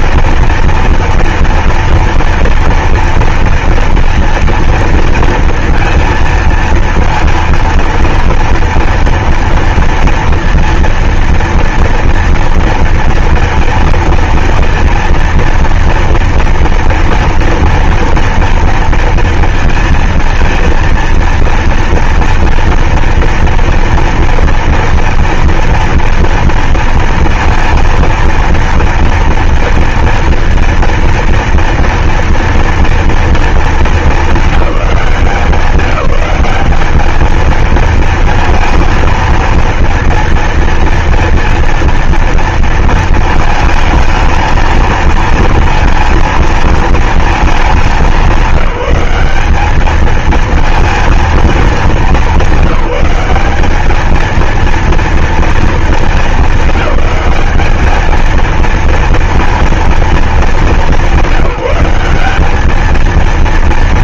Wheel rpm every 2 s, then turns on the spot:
230, 230, 230, 230, 230, 230, 230, 230, 230, 230, 230, 230, 230, 230, 230, 230, 230, 220, 190, 230, 230, 230, 220, 230, 190, 220, 200, 220, 220, 220, 220, 200.
none